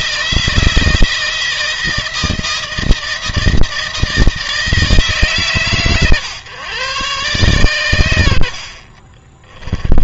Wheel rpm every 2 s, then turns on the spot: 160, 160, 160, 120, 60.
none